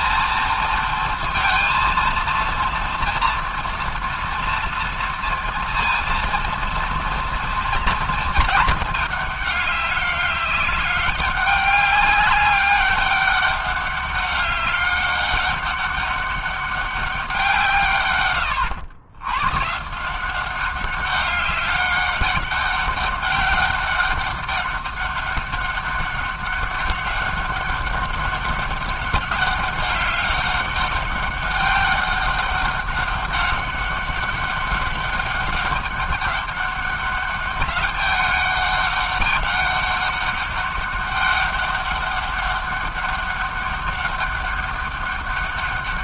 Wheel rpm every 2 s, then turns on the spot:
230, 230, 230, 230, 210, 200, 200, 200, 200, 100, 190, 200, 200, 200, 190, 200, 200, 190, 200, 200, 200, 200, 200.
none